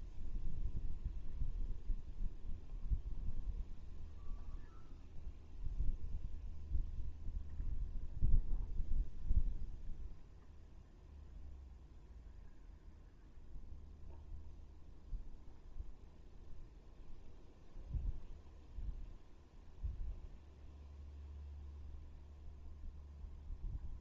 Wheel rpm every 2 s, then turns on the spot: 0, 0, 0, 0, 0, 0, 0, 0, 0, 0, 0, 0.
none